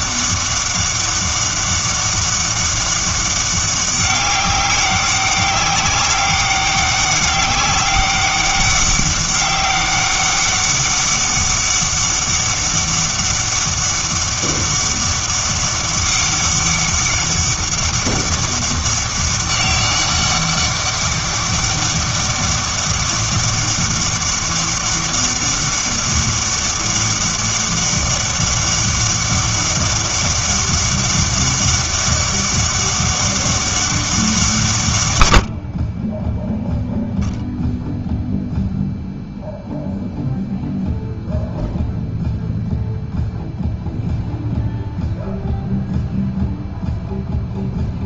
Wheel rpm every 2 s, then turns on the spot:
200, 200, 190, 200, 200, 200, 200, 200, 200, 200, 200, 200, 200, 200, 200, 200, 200, 150, 0, 0, 0, 0, 0, 0.
none